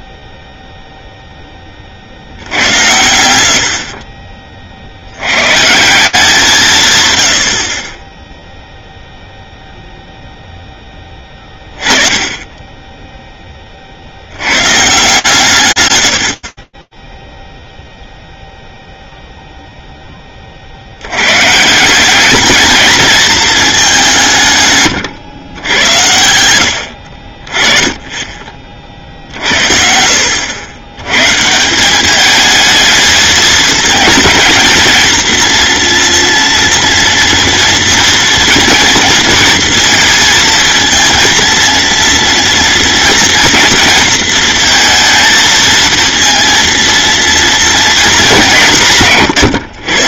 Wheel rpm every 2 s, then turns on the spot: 0, 80, 110, 100, 0, 10, 10, 140, 0, 0, 110, 220, 110, 40, 60, 150, 220, 230, 230, 230, 230, 230, 230, 230, 130.
none